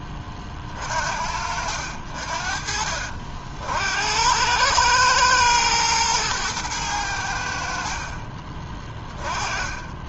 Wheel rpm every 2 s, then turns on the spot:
40, 50, 100, 110, 20.
none